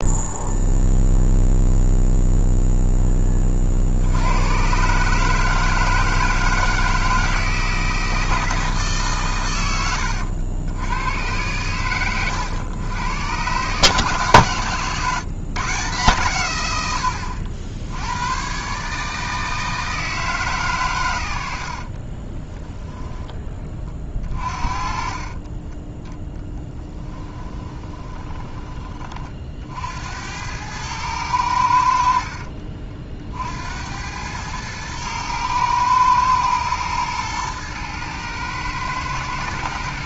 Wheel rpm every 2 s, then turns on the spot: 0, 0, 110, 160, 160, 80, 110, 130, 100, 120, 140, 20, 30, 10, 20, 100, 50, 110, 110, 110.
22-28 32-34